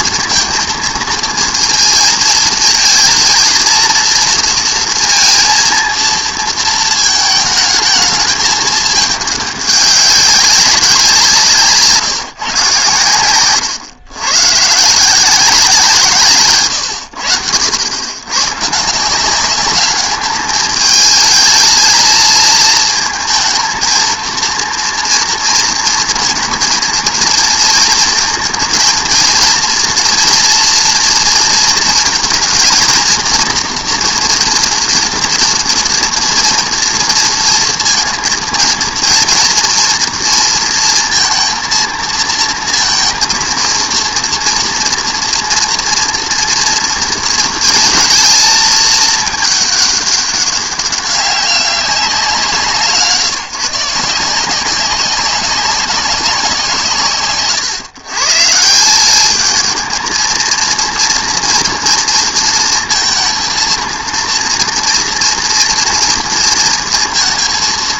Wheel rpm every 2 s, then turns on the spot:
230, 230, 230, 220, 220, 190, 120, 140, 130, 160, 220, 230, 230, 230, 230, 240, 230, 240, 230, 230, 230, 230, 240, 230, 220, 200, 160, 180, 180, 170, 230, 230, 230, 230.
none